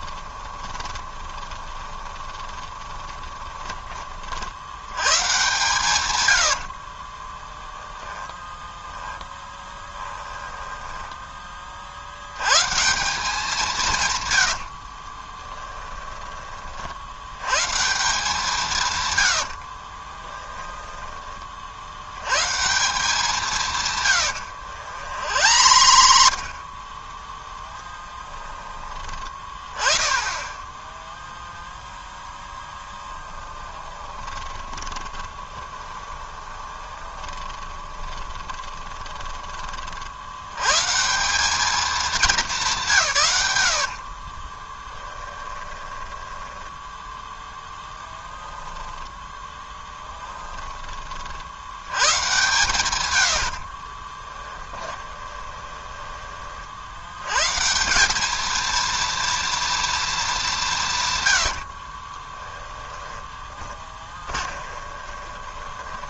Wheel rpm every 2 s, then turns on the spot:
20, 20, 90, 20, 10, 10, 150, 70, 50, 150, 10, 160, 90, 30, 20, 10, 10, 10, 20, 20, 130, 180, 20, 10, 0, 20, 120, 20, 60, 230, 160, 20, 20.
0-4 6-12 14-16 20-22 24-26 34-40 44-48 54-56 62-66